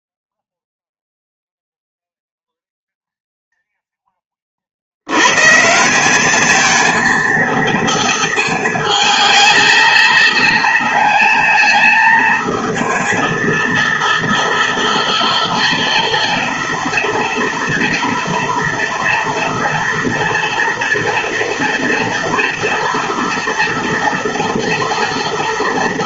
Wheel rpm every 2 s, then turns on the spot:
0, 0, 60, 220, 220, 230, 220, 240, 230, 230, 230, 230, 240.
none